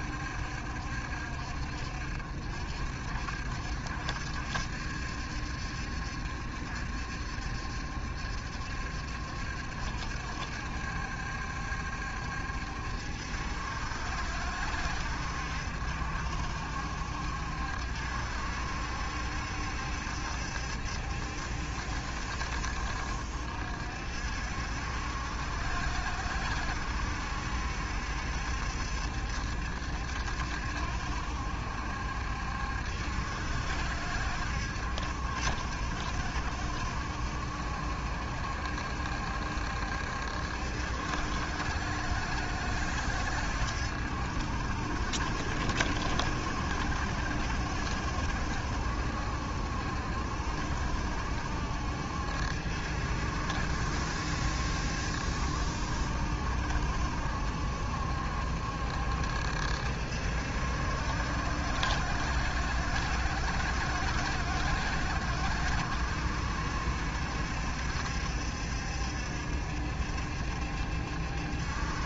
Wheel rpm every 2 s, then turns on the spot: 60, 60, 70, 70, 70, 70, 70, 70, 70, 70, 70, 60, 60, 70, 70, 60, 70, 70, 70, 70, 60, 70, 70, 70, 70, 70, 70, 70, 70, 70, 60, 70, 70, 70, 70, 70.
none